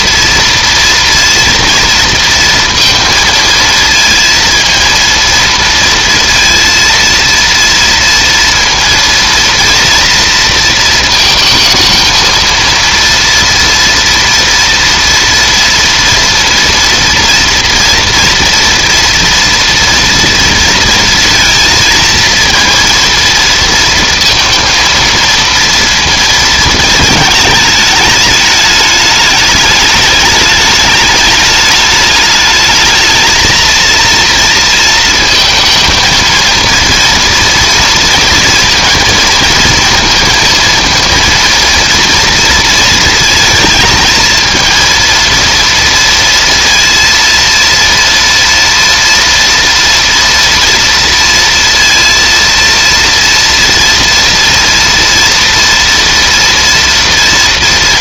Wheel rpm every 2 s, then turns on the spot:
230, 230, 230, 230, 230, 230, 230, 230, 230, 230, 230, 230, 230, 230, 210, 210, 210, 230, 230, 230, 230, 230, 230, 230, 230, 230, 230, 230, 230.
none